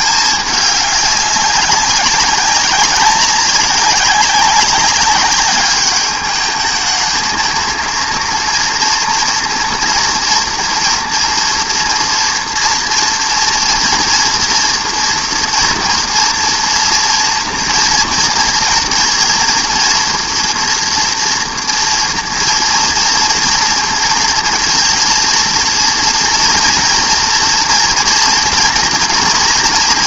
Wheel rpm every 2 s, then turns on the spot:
200, 200, 200, 210, 230, 230, 230, 230, 240, 230, 230, 230, 230, 230, 230.
none